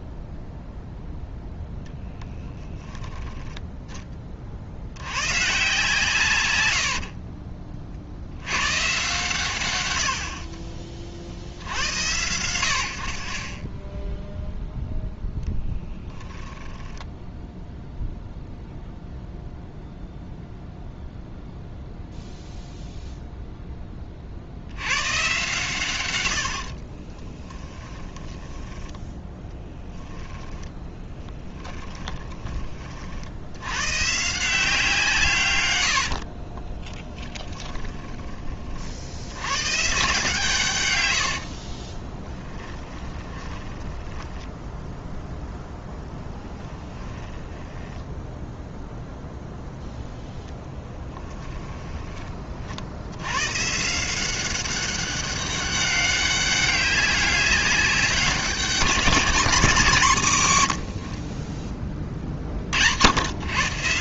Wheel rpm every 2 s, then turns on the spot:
0, 10, 80, 90, 120, 40, 90, 0, 10, 0, 0, 0, 90, 60, 10, 20, 30, 170, 40, 50, 120, 20, 10, 10, 0, 10, 60, 200, 200, 190, 110, 60.
6-8 16-18 26-32 36-38 42-48 50-52